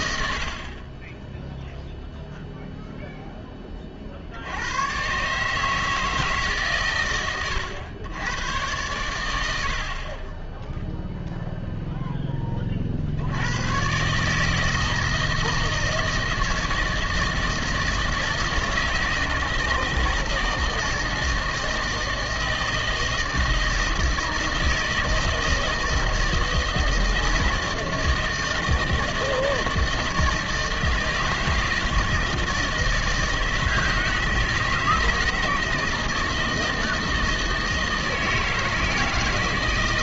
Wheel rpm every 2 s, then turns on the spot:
90, 0, 90, 150, 100, 10, 30, 160, 160, 160, 160, 160, 160, 160, 160, 160, 160, 160, 160, 160.
none